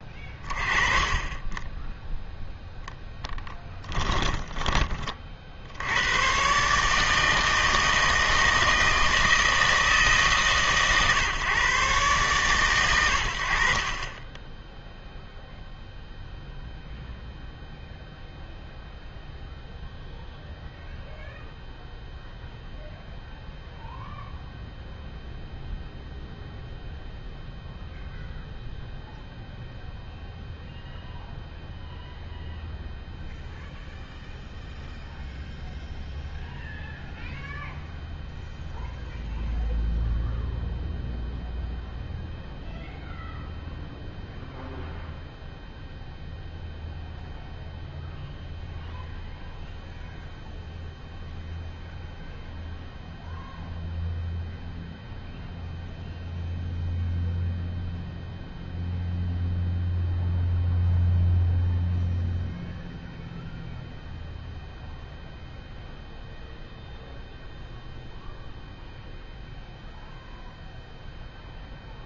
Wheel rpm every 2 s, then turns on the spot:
20, 0, 20, 150, 160, 140, 120, 0, 0, 0, 0, 0, 0, 0, 0, 0, 0, 0, 0, 0, 0, 0, 0, 0, 0, 0, 0, 0, 0, 0, 0, 0, 0, 0, 0, 0.
4-6